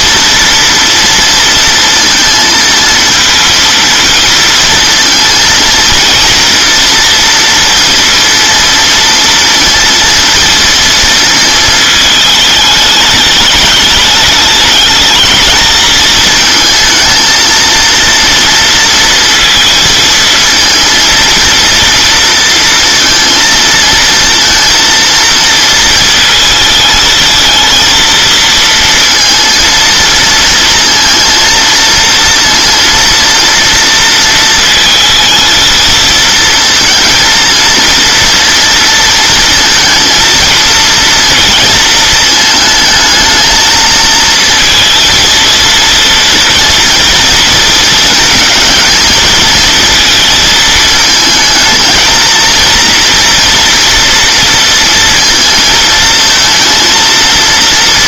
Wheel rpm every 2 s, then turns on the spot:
230, 230, 230, 230, 230, 230, 210, 210, 220, 230, 230, 230, 230, 220, 230, 230, 230, 230, 230, 230, 230, 220, 230, 230, 230, 220, 230, 230, 230.
none